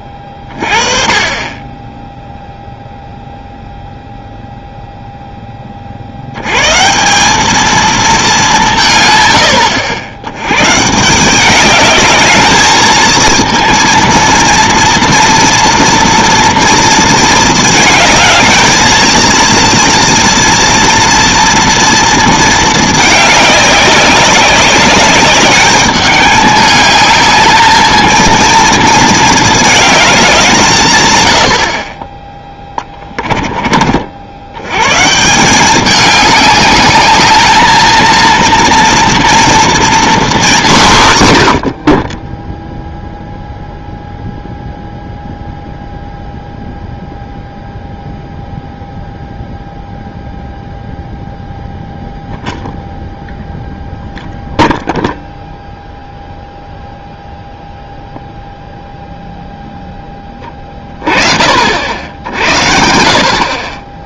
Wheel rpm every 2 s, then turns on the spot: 30, 0, 0, 120, 180, 120, 220, 230, 230, 220, 230, 220, 190, 210, 230, 180, 20, 110, 200, 230, 200, 0, 0, 0, 0, 0, 0, 0, 0, 0, 30, 80.
32-34